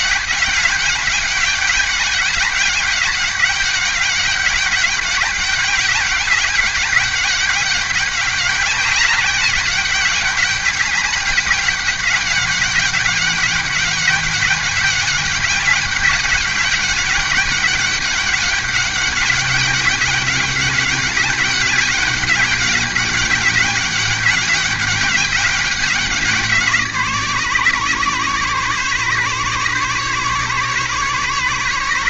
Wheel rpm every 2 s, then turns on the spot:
200, 200, 200, 200, 200, 200, 200, 200, 200, 200, 200, 200, 190, 180, 140, 140.
none